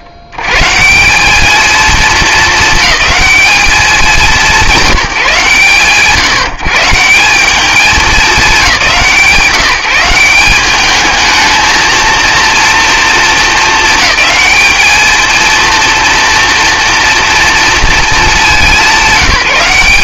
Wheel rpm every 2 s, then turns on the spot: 60, 210, 180, 160, 190, 190, 230, 210, 230, 190.
none